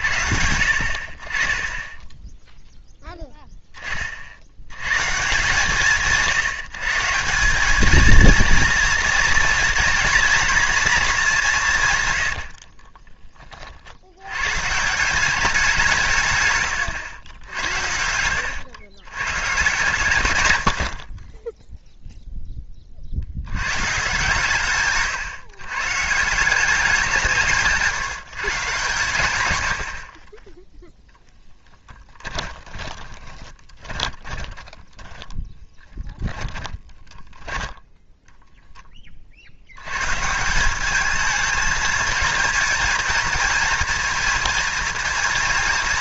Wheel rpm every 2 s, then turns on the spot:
60, 0, 120, 160, 230, 230, 50, 150, 100, 100, 60, 30, 140, 180, 120, 10, 20, 10, 10, 10, 190, 220, 230.
12-14 24-26 32-38